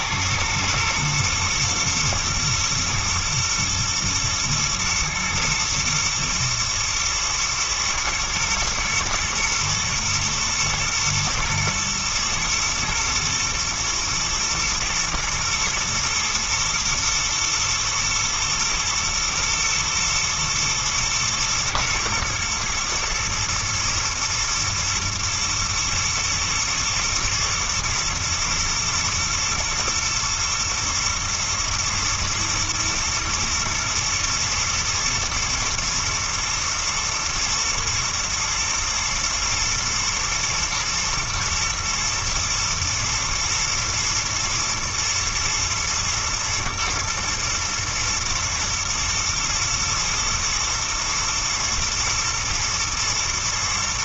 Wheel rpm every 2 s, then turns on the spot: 110, 110, 120, 110, 110, 110, 120, 120, 120, 120, 120, 120, 110, 110, 110, 110, 120, 120, 120, 120, 110, 120, 110, 110, 120, 120, 110.
none